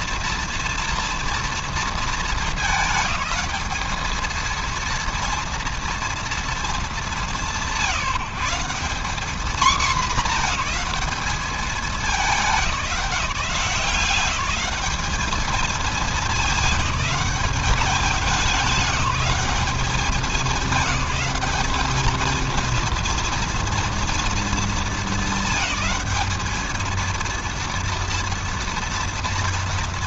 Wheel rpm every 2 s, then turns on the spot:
230, 220, 230, 220, 200, 210, 180, 200, 200, 200, 210, 230, 220, 210, 230.
none